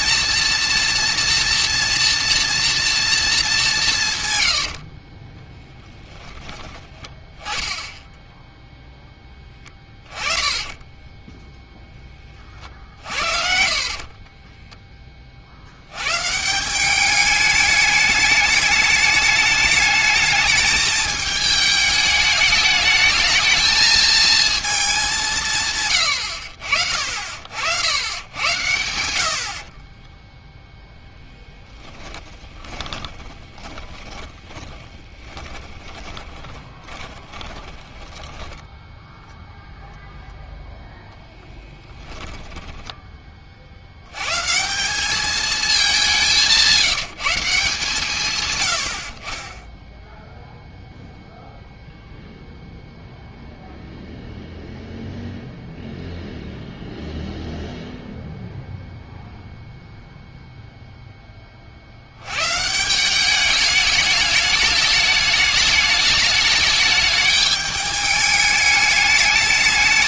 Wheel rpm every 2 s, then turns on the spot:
230, 230, 90, 10, 0, 10, 40, 20, 170, 210, 220, 210, 220, 70, 90, 10, 20, 20, 20, 10, 10, 10, 150, 160, 90, 0, 0, 0, 0, 0, 0, 130, 210, 210, 210.
4-6 10-12 14-16 32-40 42-44